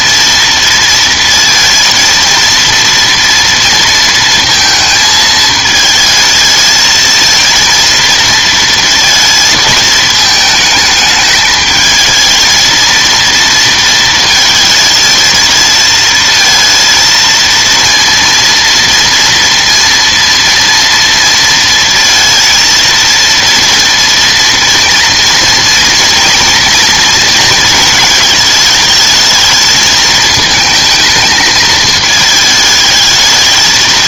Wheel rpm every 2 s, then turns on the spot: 230, 230, 230, 220, 230, 220, 230, 220, 230, 230, 230, 230, 230, 230, 220, 220, 220.
none